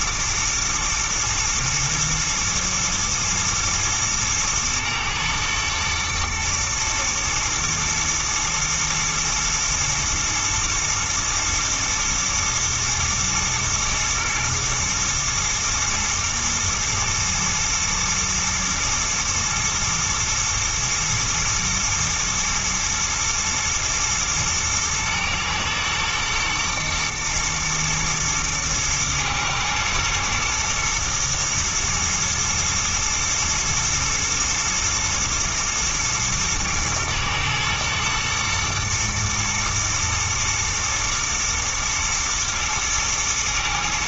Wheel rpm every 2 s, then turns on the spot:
110, 110, 110, 120, 110, 120, 120, 110, 120, 120, 120, 110, 110, 110, 110, 110, 120, 110, 120, 120, 110, 120.
none